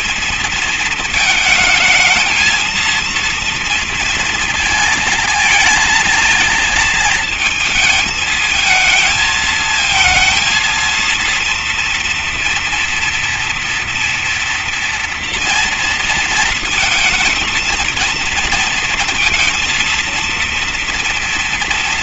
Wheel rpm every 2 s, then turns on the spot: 220, 230, 230, 220, 220, 230, 230, 240, 230, 230, 230.
none